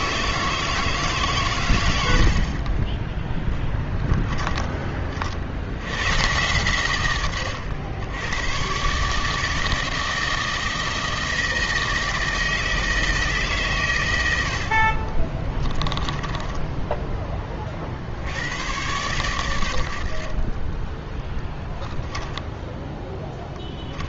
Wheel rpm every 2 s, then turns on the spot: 160, 40, 20, 120, 120, 160, 160, 60, 10, 110, 20, 10.
16-18